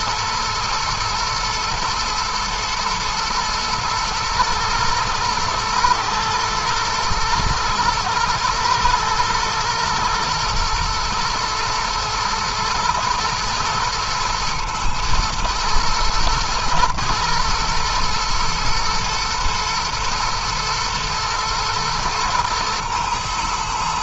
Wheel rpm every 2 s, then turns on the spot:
110, 120, 120, 110, 120, 110, 110, 110, 120, 120, 120, 120.
none